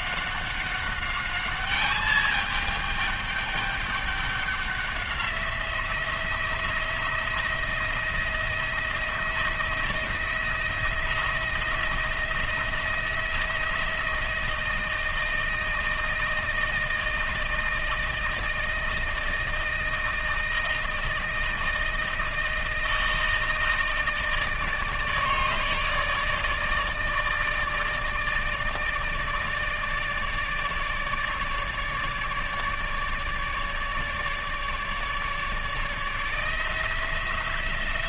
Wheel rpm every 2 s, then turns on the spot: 200, 210, 190, 170, 170, 170, 170, 160, 160, 160, 160, 160, 150, 160, 160, 150, 150, 150, 160.
none